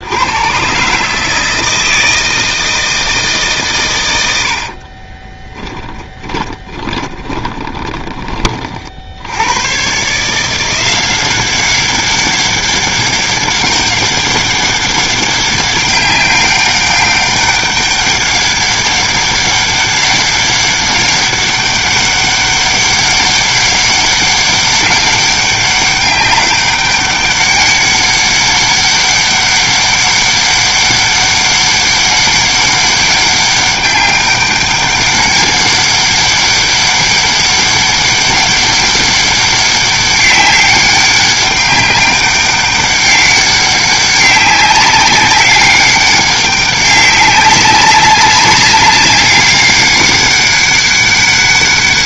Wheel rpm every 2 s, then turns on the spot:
130, 160, 60, 30, 40, 170, 200, 200, 200, 200, 200, 190, 190, 200, 200, 200, 200, 200, 200, 200, 200, 200, 200, 200, 200, 200.
4-8